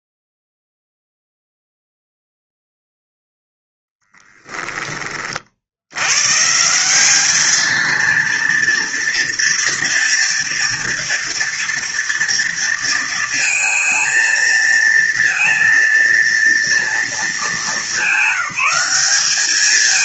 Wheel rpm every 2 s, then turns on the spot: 0, 0, 30, 200, 230, 240, 230, 230, 220, 200.
none